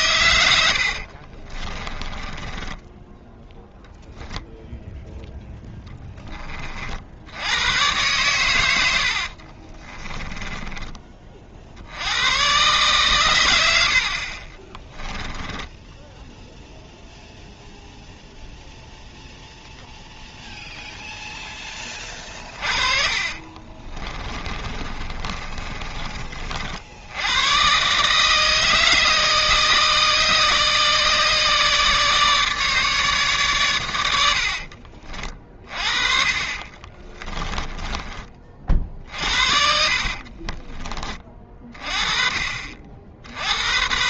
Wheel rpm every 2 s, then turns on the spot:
70, 10, 0, 50, 90, 20, 130, 20, 0, 0, 0, 30, 30, 60, 160, 150, 150, 50, 30, 40, 30, 50.
0-4 8-10 14-16 22-26 34-42